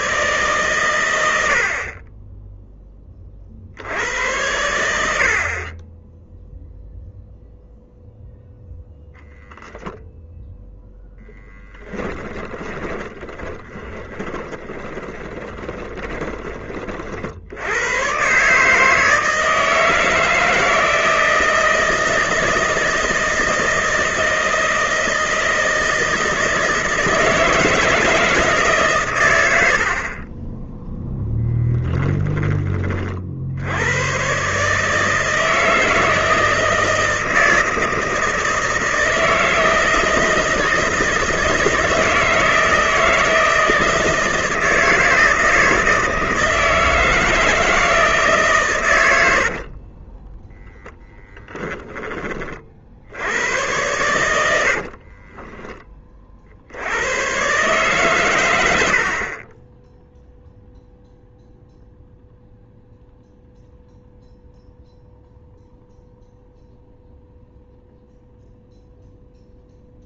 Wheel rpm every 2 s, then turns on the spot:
110, 20, 80, 0, 0, 0, 20, 20, 40, 150, 160, 160, 160, 160, 140, 10, 40, 160, 160, 160, 160, 160, 160, 160, 110, 0, 60, 60, 80, 80, 0, 0, 0, 0, 0.
12-16 54-56